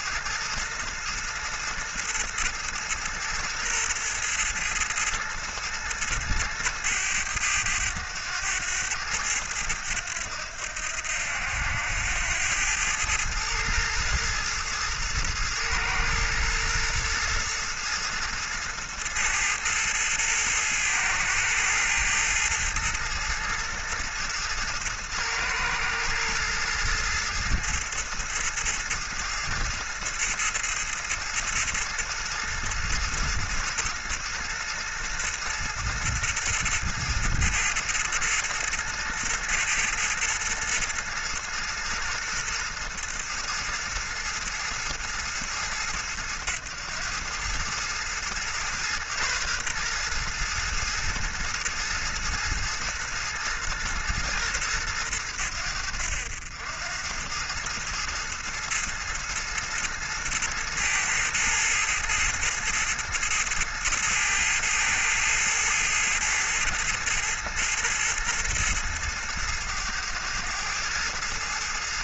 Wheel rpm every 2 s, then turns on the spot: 110, 110, 110, 110, 100, 90, 100, 110, 110, 110, 110, 110, 110, 110, 110, 110, 110, 110, 110, 110, 110, 110, 110, 100, 120, 120, 110, 110, 90, 110, 110, 110, 110, 110, 110, 110.
none